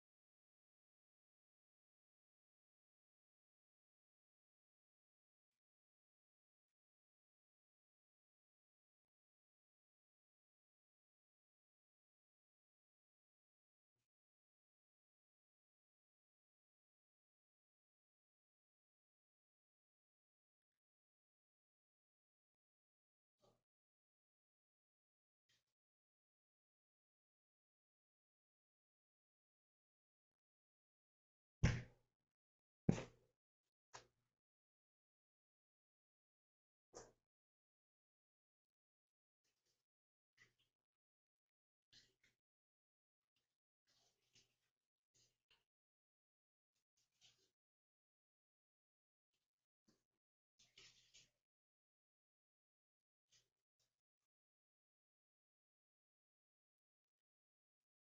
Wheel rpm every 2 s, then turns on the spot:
0, 0, 0, 0, 0, 0, 0, 0, 0, 0, 0, 0, 0, 0, 0, 0, 0, 0, 0, 0, 0, 0, 0, 0, 0, 0, 0, 0, 0.
none